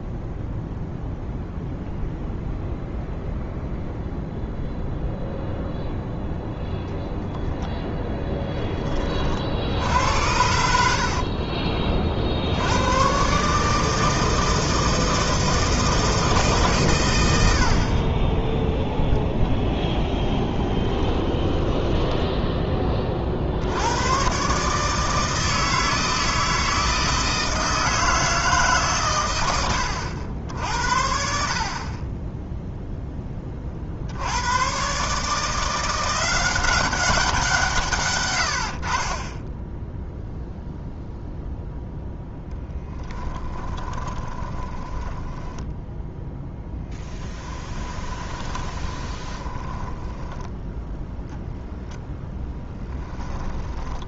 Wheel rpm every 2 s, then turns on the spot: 0, 0, 0, 0, 20, 70, 100, 160, 130, 10, 20, 20, 150, 160, 140, 70, 0, 120, 190, 50, 0, 10, 30, 10, 20, 0, 10.
10-12 20-22 42-46 48-50 52-54